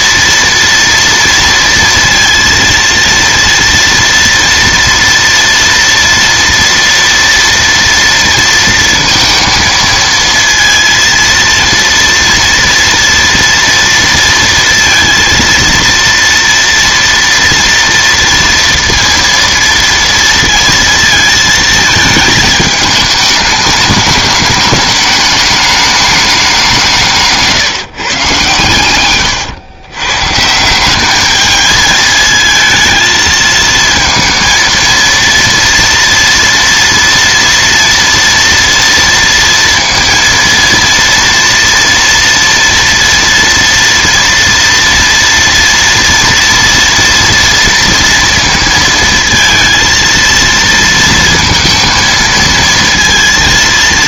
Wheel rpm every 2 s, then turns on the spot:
230, 230, 230, 230, 230, 230, 230, 230, 230, 230, 230, 210, 210, 180, 110, 190, 220, 230, 230, 230, 230, 230, 230, 240, 230, 230, 230.
none